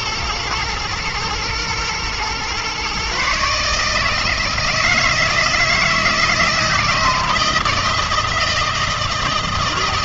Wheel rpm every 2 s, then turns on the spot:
110, 120, 160, 160, 160.
none